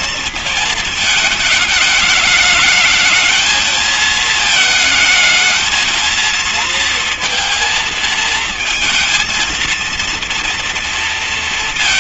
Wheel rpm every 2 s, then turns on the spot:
220, 220, 220, 230, 220, 230.
none